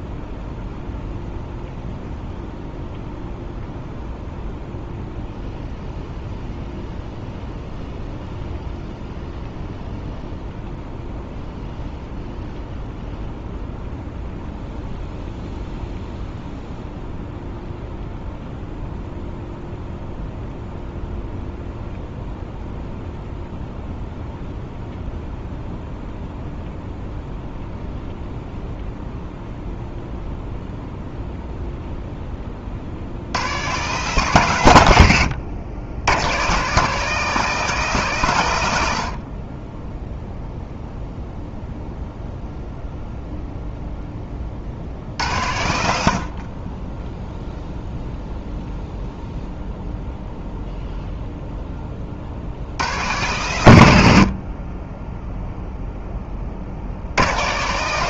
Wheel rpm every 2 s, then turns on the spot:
0, 0, 0, 0, 0, 0, 0, 0, 0, 0, 0, 0, 0, 0, 0, 0, 40, 130, 150, 120, 0, 0, 50, 30, 0, 0, 90, 30, 50.
none